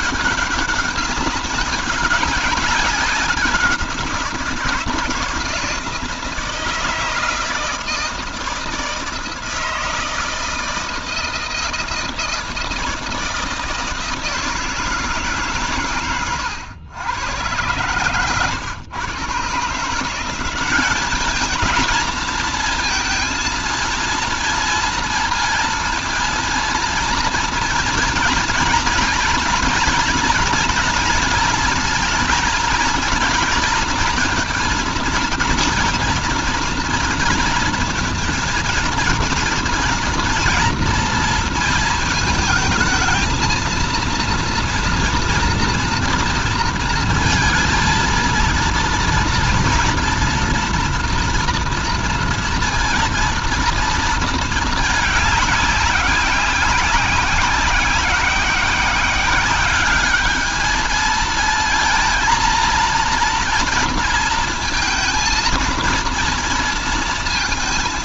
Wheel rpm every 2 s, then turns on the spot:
200, 190, 160, 160, 160, 160, 160, 160, 100, 120, 200, 230, 230, 230, 230, 230, 230, 230, 230, 230, 240, 220, 230, 230, 230, 230, 230, 220, 190, 180, 210, 230, 230, 230.
none